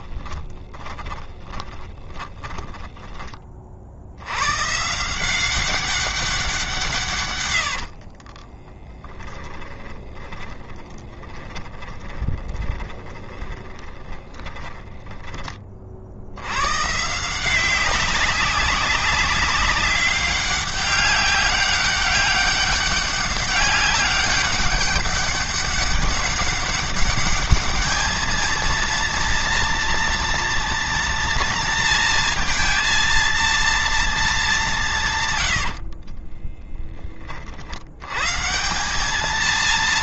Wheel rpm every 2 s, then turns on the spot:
20, 20, 140, 170, 20, 10, 20, 20, 130, 190, 200, 200, 200, 200, 230, 230, 230, 190, 20, 190.
0-4 8-16